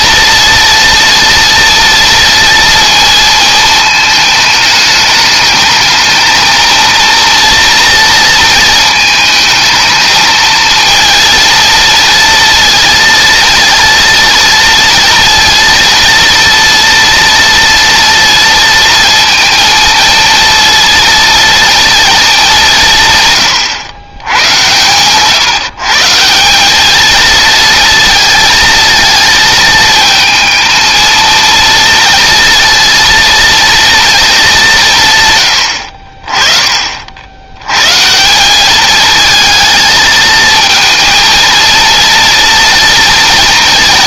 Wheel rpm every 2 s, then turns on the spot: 230, 230, 210, 230, 220, 220, 230, 230, 230, 230, 230, 160, 120, 210, 230, 230, 230, 150, 60, 220, 230, 230.
none